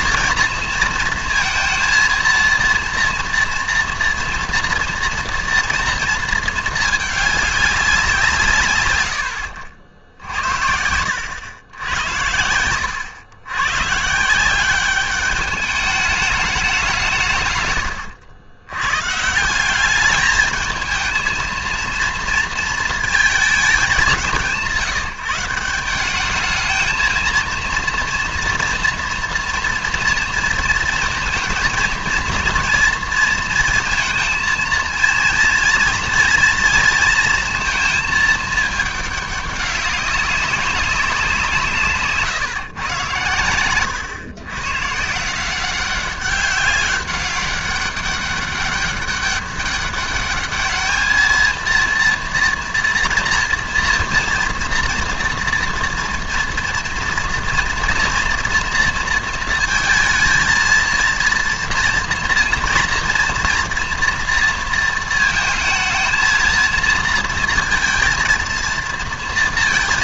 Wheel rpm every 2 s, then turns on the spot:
230, 230, 230, 220, 130, 70, 80, 190, 200, 90, 220, 230, 170, 220, 240, 230, 230, 230, 240, 220, 190, 130, 120, 200, 200, 210, 230, 230, 240, 230, 230, 230, 230, 220, 230.
10-12